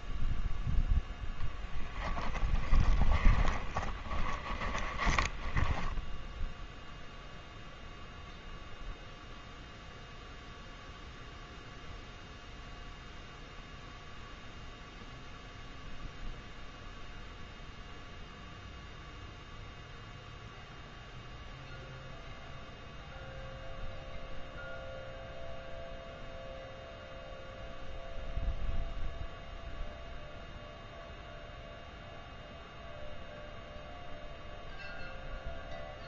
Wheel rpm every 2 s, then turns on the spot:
0, 20, 20, 0, 0, 0, 0, 0, 0, 0, 0, 0, 0, 0, 0, 0, 0, 0.
2-6